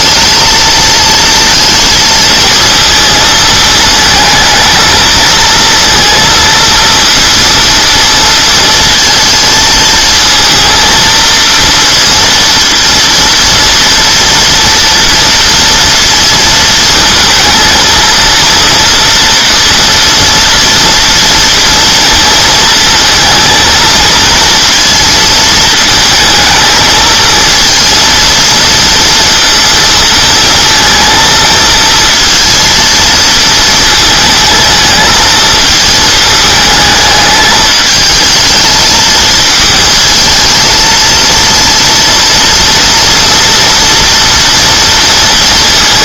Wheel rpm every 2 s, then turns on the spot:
220, 230, 230, 230, 230, 230, 230, 230, 230, 230, 230, 220, 230, 220, 230, 230, 230, 230, 220, 220, 220, 230, 230.
none